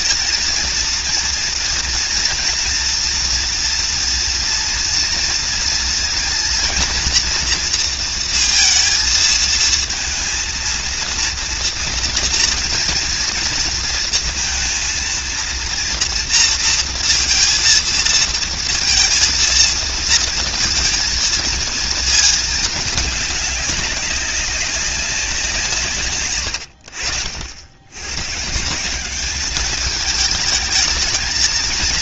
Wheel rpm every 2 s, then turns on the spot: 230, 230, 230, 230, 230, 230, 240, 230, 230, 230, 230, 220, 190, 100, 150, 220.
none